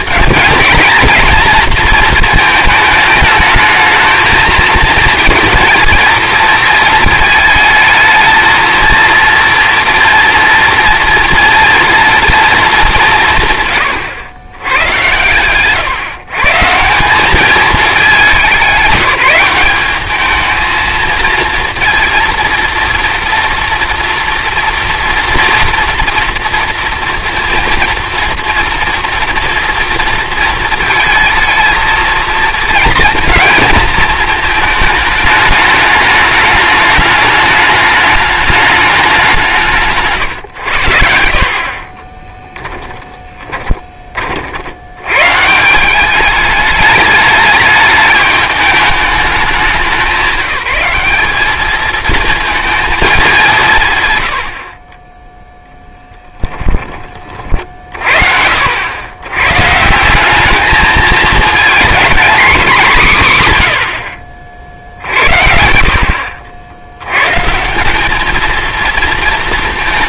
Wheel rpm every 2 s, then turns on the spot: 180, 220, 220, 220, 220, 230, 220, 100, 140, 190, 220, 230, 230, 230, 230, 230, 220, 220, 210, 210, 100, 10, 70, 210, 210, 190, 220, 50, 10, 70, 210, 190, 50, 80, 220.
42-44 56-58